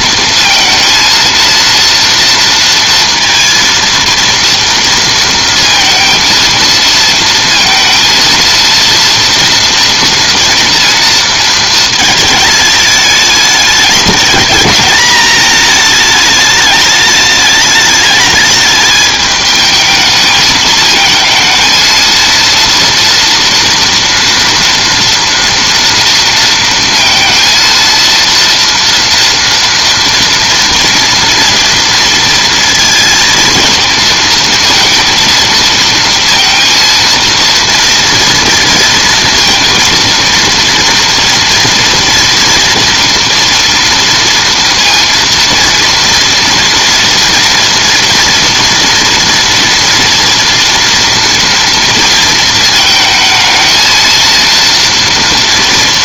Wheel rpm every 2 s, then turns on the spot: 230, 230, 230, 230, 230, 230, 220, 220, 210, 210, 220, 230, 230, 230, 230, 230, 230, 230, 230, 230, 230, 240, 230, 230, 230, 230, 220, 230.
none